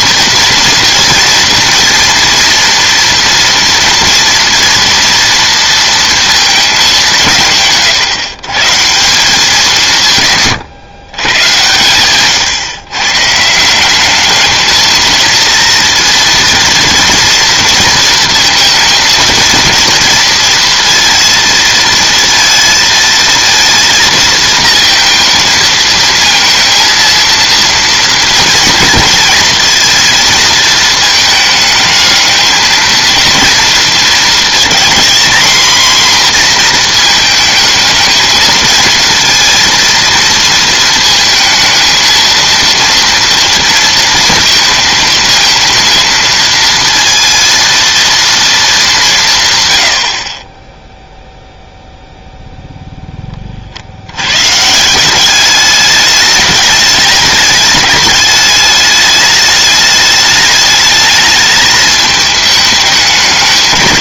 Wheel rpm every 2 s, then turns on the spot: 230, 230, 230, 210, 150, 140, 130, 220, 230, 230, 230, 230, 230, 230, 230, 230, 220, 230, 240, 220, 230, 230, 220, 230, 220, 20, 0, 150, 210, 210, 210, 210.
none